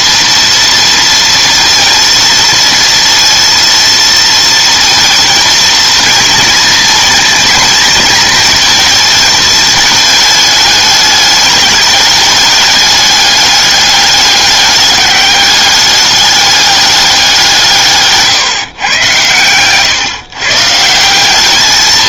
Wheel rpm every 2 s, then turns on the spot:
230, 230, 230, 230, 230, 210, 200, 200, 210, 130, 140.
none